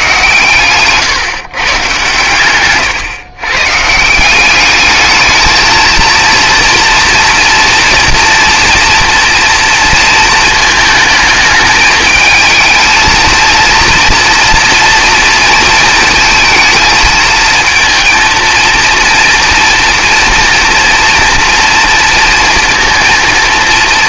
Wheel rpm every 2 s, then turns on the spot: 140, 120, 210, 230, 230, 220, 220, 230, 220, 230, 230, 230.
none